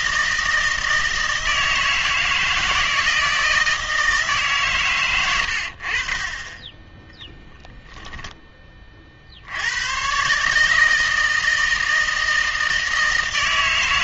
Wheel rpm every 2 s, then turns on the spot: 160, 160, 130, 10, 20, 150, 160.
none